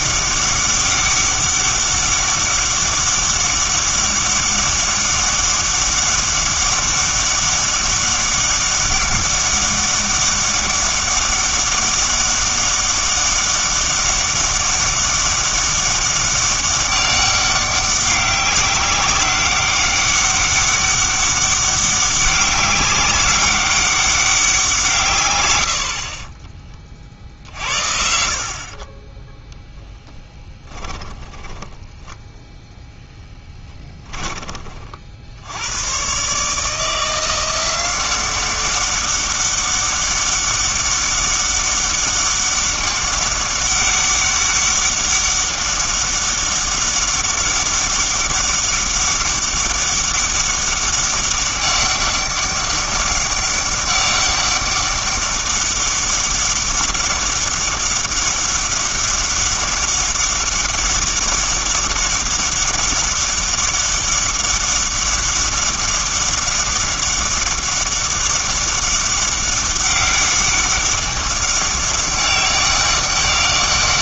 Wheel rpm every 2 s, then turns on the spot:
200, 200, 200, 200, 200, 200, 200, 200, 200, 190, 200, 200, 170, 30, 40, 10, 0, 30, 150, 190, 200, 200, 200, 200, 200, 200, 200, 200, 200, 200, 200, 200, 200, 200, 200, 200, 200.
28-32